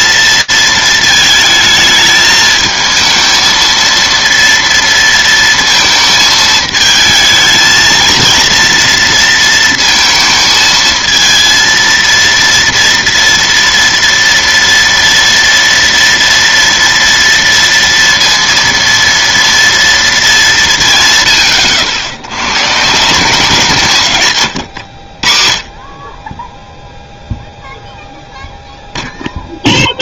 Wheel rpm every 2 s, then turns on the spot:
230, 220, 230, 220, 230, 230, 230, 230, 230, 230, 220, 90, 150, 20, 0.
none